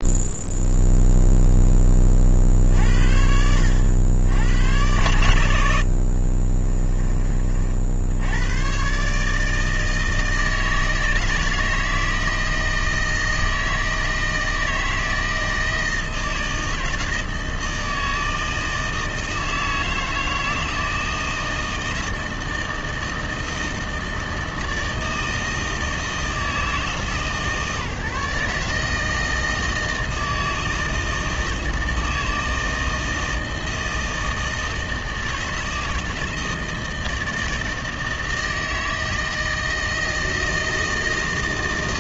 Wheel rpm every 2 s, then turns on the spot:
0, 60, 100, 20, 120, 160, 160, 160, 160, 160, 160, 160, 160, 160, 160, 160, 160, 160, 160, 160, 160.
none